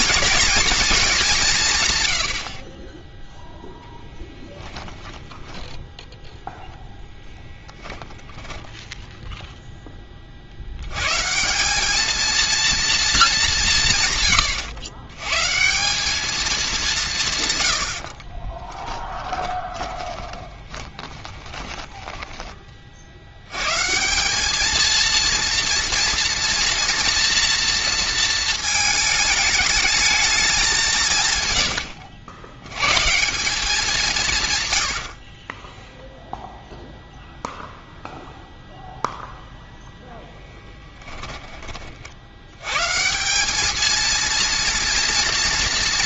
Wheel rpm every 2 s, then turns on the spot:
240, 50, 10, 0, 0, 80, 230, 120, 210, 20, 20, 20, 210, 230, 220, 200, 110, 120, 0, 0, 10, 100, 230.
4-6 18-22 40-42